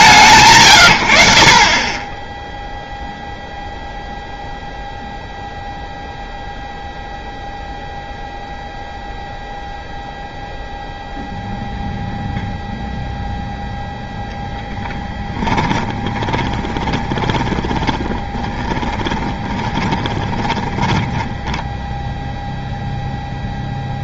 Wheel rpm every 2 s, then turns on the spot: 140, 0, 0, 0, 0, 0, 0, 10, 20, 20, 20, 0.
14-22